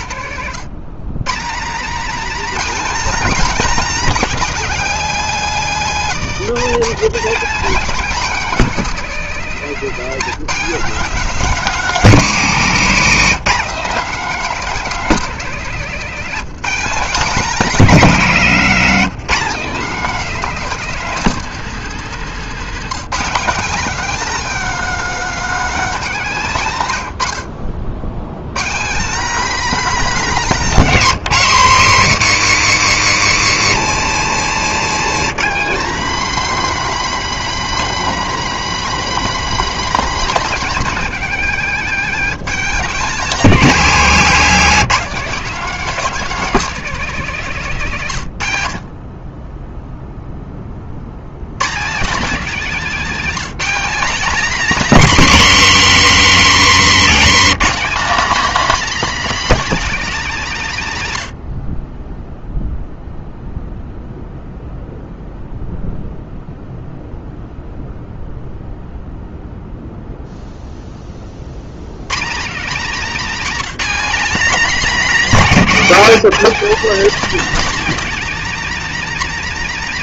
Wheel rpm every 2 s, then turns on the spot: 160, 280, 270, 210, 250, 230, 210, 250, 210, 210, 240, 220, 260, 120, 190, 220, 150, 150, 260, 260, 240, 210, 220, 230, 50, 60, 240, 260, 220, 290, 170, 0, 0, 0, 0, 20, 240, 260, 250, 270.
56-58